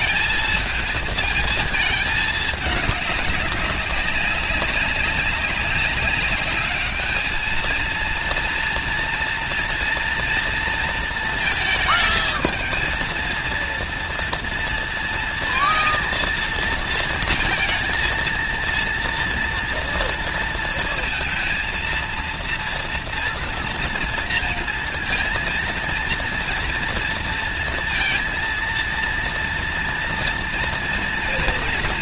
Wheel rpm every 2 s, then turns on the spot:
220, 210, 190, 200, 230, 230, 220, 230, 230, 230, 230, 230, 230, 230, 230, 230.
none